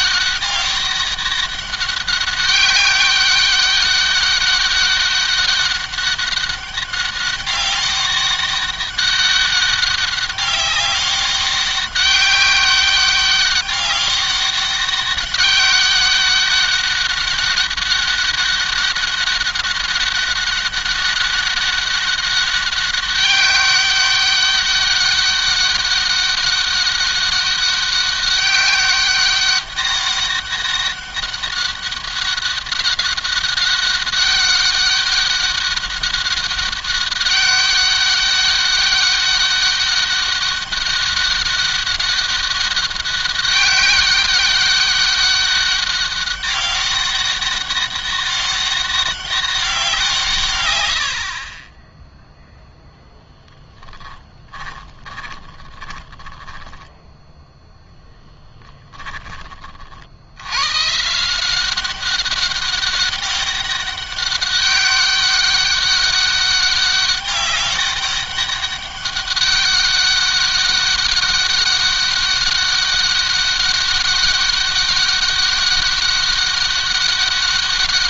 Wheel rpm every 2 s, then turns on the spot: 200, 200, 200, 200, 200, 200, 190, 200, 200, 200, 200, 200, 200, 190, 200, 200, 200, 200, 200, 200, 200, 200, 190, 190, 200, 110, 0, 20, 10, 10, 110, 200, 200, 200, 200, 200, 190, 190, 200.
54-60